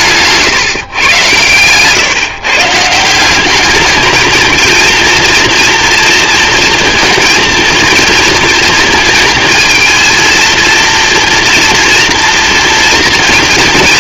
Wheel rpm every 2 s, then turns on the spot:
140, 150, 230, 230, 220, 230, 230.
none